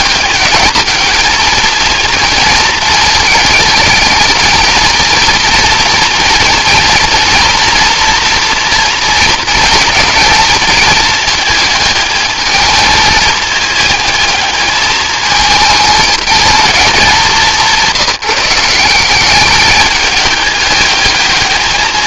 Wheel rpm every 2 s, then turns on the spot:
210, 220, 230, 230, 230, 220, 220, 220, 220, 190, 210.
none